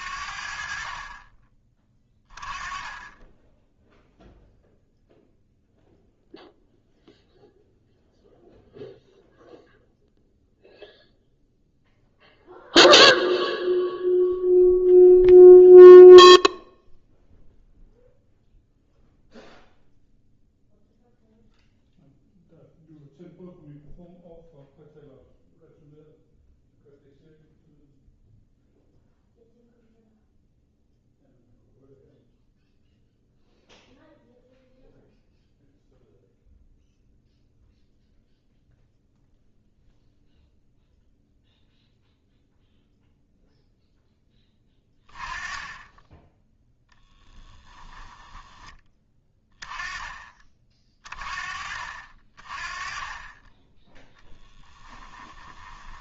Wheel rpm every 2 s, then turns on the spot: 50, 20, 0, 0, 0, 0, 0, 0, 0, 0, 0, 0, 0, 0, 0, 0, 0, 0, 0, 0, 0, 0, 20, 0, 10, 30, 30, 10.
54-56